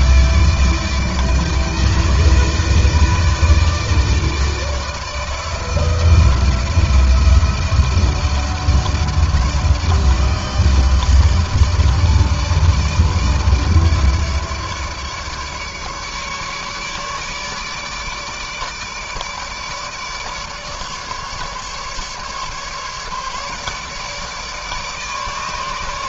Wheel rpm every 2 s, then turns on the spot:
160, 160, 160, 160, 160, 160, 160, 150, 150, 150, 150, 140, 150.
none